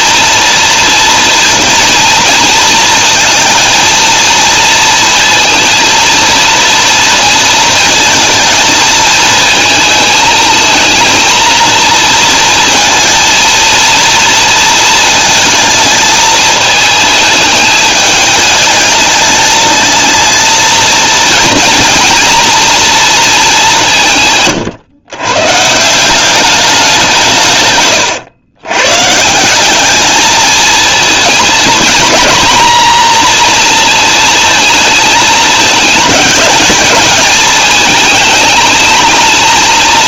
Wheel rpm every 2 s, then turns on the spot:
230, 230, 230, 230, 220, 220, 230, 230, 220, 210, 230, 230, 130, 200, 130, 230, 230, 220, 220, 220.
none